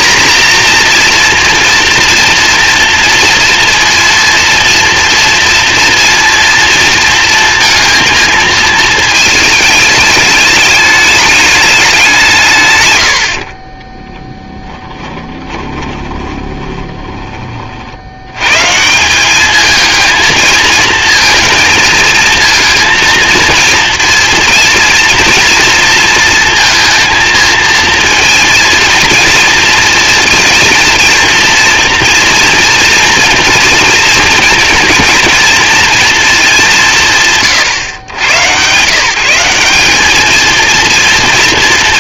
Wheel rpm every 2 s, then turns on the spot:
230, 230, 230, 230, 220, 210, 130, 10, 20, 150, 230, 230, 230, 230, 230, 230, 230, 230, 190, 160, 230.
14-18